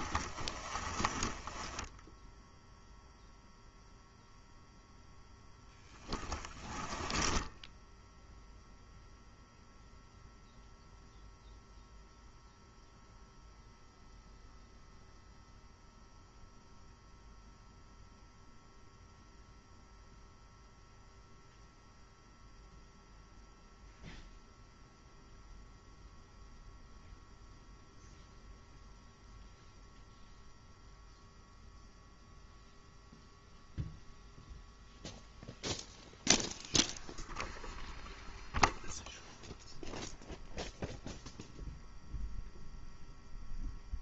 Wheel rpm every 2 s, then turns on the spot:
20, 0, 0, 20, 0, 0, 0, 0, 0, 0, 0, 0, 0, 0, 0, 0, 0, 0, 0, 0, 0, 0.
none